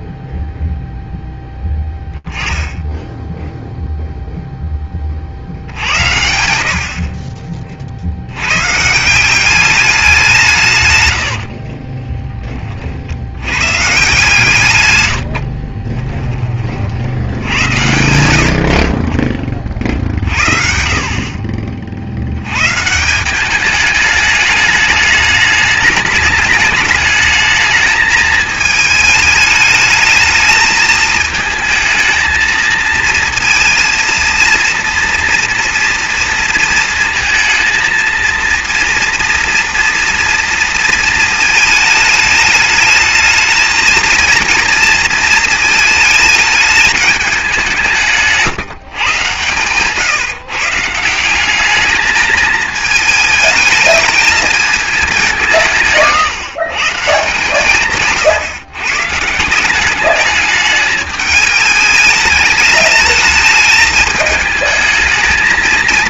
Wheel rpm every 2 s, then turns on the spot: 0, 10, 0, 80, 90, 180, 20, 130, 20, 70, 50, 100, 210, 210, 210, 210, 220, 230, 230, 230, 230, 210, 230, 220, 160, 150, 220, 220, 170, 130, 210, 210, 220.
none